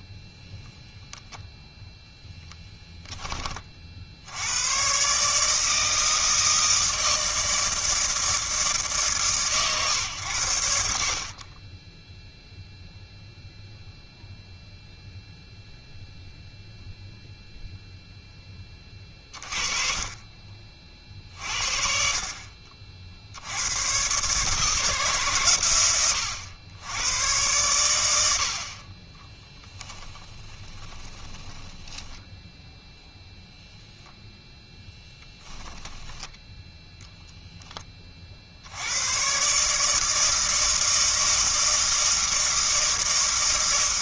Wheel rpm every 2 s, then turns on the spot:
0, 10, 110, 160, 150, 80, 0, 0, 0, 20, 40, 50, 160, 90, 40, 20, 0, 10, 10, 80, 160, 160.
30-32 34-36